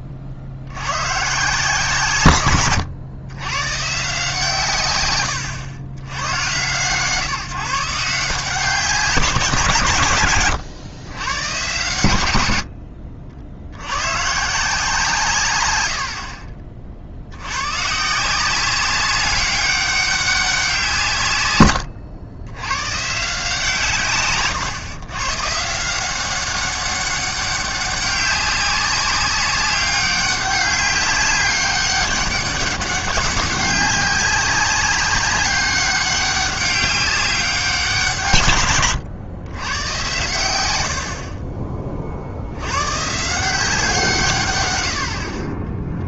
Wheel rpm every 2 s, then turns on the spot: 90, 120, 140, 120, 180, 120, 70, 160, 50, 180, 180, 110, 120, 190, 190, 200, 200, 190, 200, 130, 90, 100, 120.
2-4